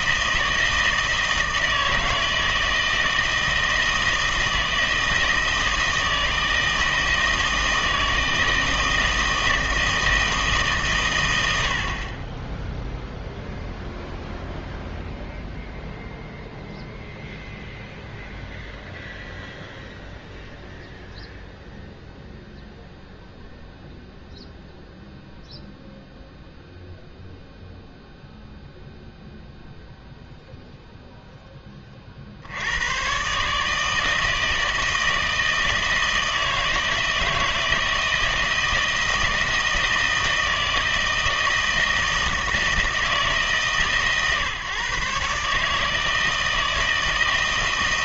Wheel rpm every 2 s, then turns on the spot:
160, 160, 160, 160, 160, 140, 0, 0, 0, 0, 0, 0, 0, 0, 0, 0, 100, 160, 160, 160, 160, 160, 140, 160.
none